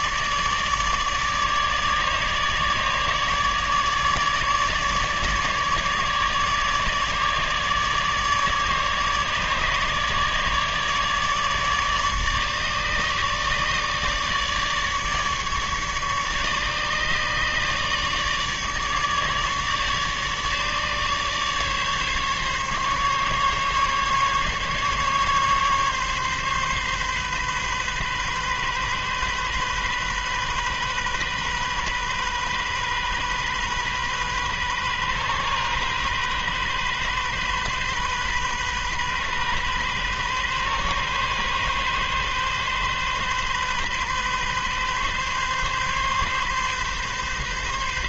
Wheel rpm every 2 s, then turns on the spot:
150, 150, 150, 150, 150, 150, 150, 150, 150, 150, 150, 140, 140, 140, 130, 130, 130, 130, 130, 130, 130, 130, 130, 140.
none